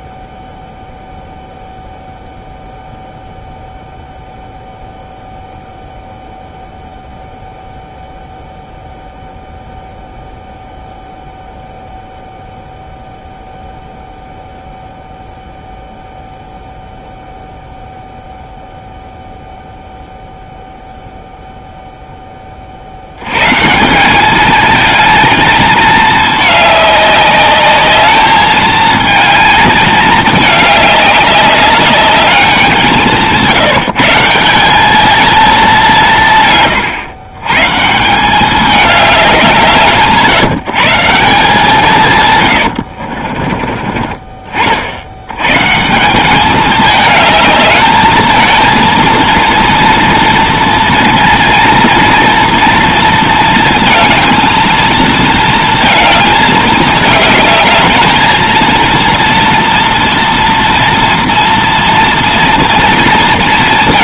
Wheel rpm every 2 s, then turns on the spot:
0, 0, 0, 0, 0, 0, 0, 0, 0, 0, 0, 50, 220, 210, 220, 210, 190, 200, 120, 210, 170, 80, 50, 210, 230, 230, 230, 220, 210, 230, 230, 230.
42-44